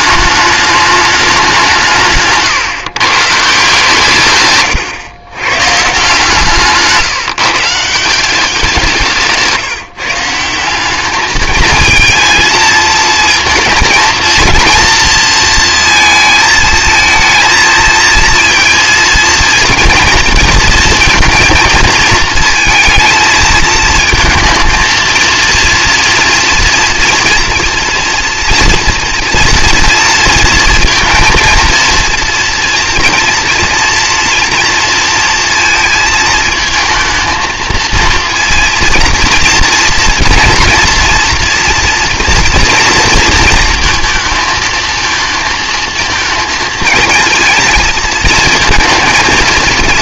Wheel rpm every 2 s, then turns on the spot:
210, 130, 130, 160, 180, 180, 230, 230, 220, 230, 230, 220, 220, 230, 230, 230, 230, 230, 230, 230, 230, 230, 220, 220, 220.
4-6